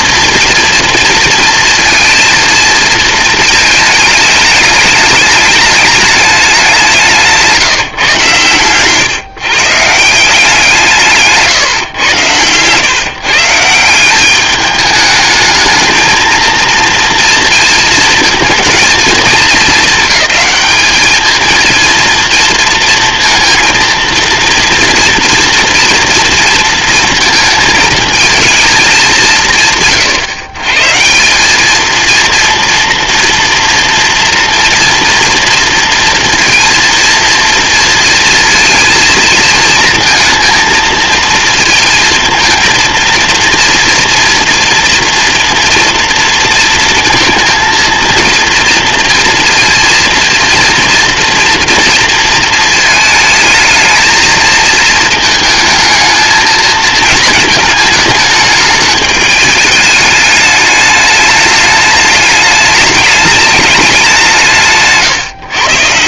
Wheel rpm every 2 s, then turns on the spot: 230, 230, 210, 170, 130, 160, 140, 210, 230, 220, 210, 230, 230, 230, 190, 170, 240, 230, 230, 220, 230, 230, 230, 220, 230, 230, 220, 220, 220, 210, 210, 210, 150.
none